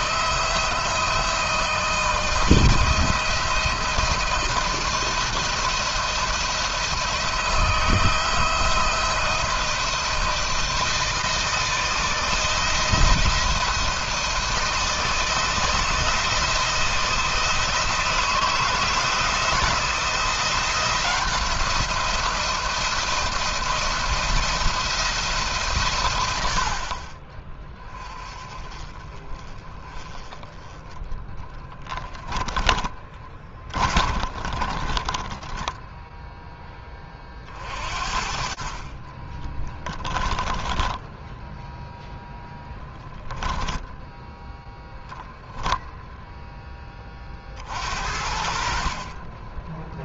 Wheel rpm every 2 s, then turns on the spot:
160, 160, 160, 170, 170, 160, 160, 160, 160, 160, 170, 170, 160, 30, 30, 20, 20, 20, 20, 30, 10, 10, 0, 30, 40.
30-34 38-44